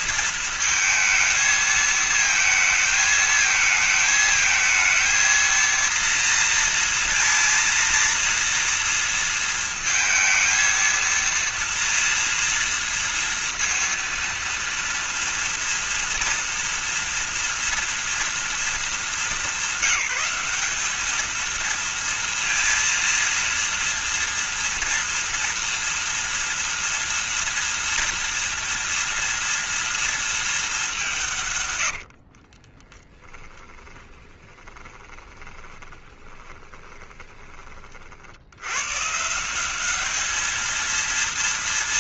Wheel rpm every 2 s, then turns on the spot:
220, 220, 220, 230, 230, 230, 230, 230, 230, 220, 200, 230, 240, 230, 230, 220, 50, 20, 20, 80, 220.
32-38